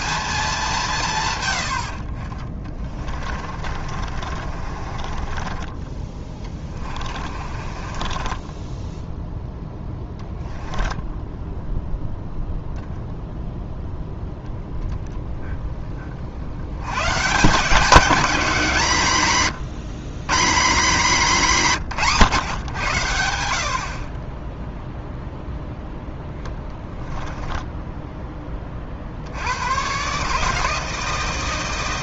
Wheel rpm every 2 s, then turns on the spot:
180, 30, 40, 20, 10, 10, 0, 10, 100, 180, 200, 110, 0, 10, 20, 160.
2-12 26-28